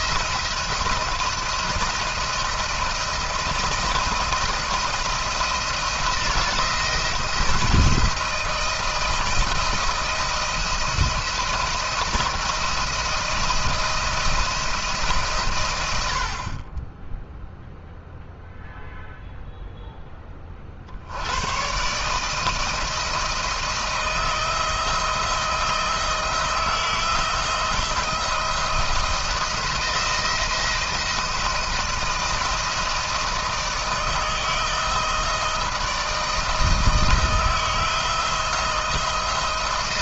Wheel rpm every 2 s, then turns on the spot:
170, 170, 170, 160, 160, 170, 160, 160, 30, 0, 50, 160, 160, 160, 170, 170, 160, 160, 160, 170.
none